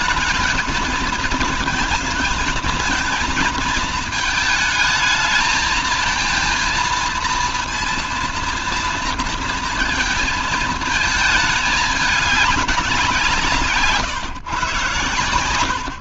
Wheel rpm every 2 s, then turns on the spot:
220, 220, 220, 230, 230, 220, 200, 130.
none